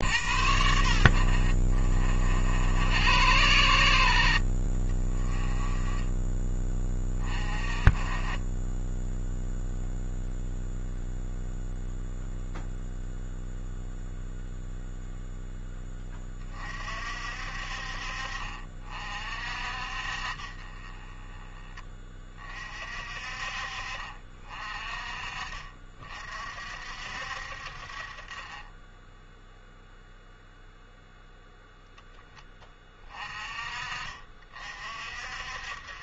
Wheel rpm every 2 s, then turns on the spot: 70, 80, 40, 20, 10, 0, 0, 0, 40, 50, 30, 40, 40, 60, 20, 0, 20, 50.
none